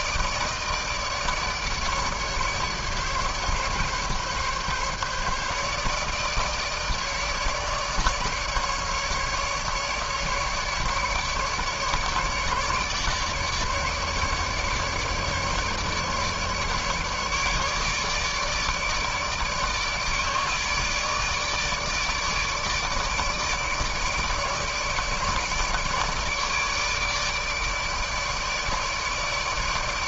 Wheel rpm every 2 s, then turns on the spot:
150, 150, 150, 150, 150, 150, 150, 150, 150, 150, 150, 150, 150, 150, 150.
none